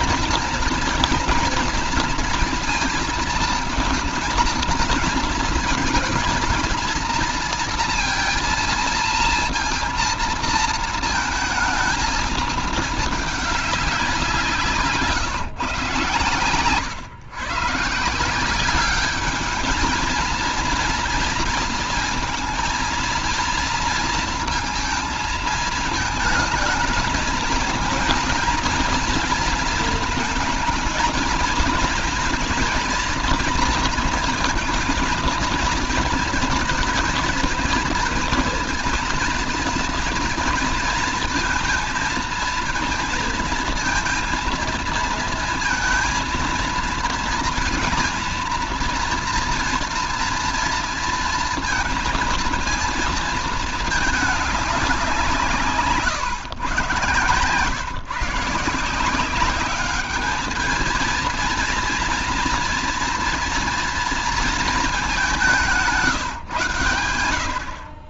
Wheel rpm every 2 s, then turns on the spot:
240, 230, 220, 230, 230, 230, 220, 170, 120, 180, 230, 220, 230, 220, 230, 230, 230, 230, 230, 230, 230, 230, 230, 230, 230, 230, 230, 210, 130, 160, 210, 230, 230, 130.
none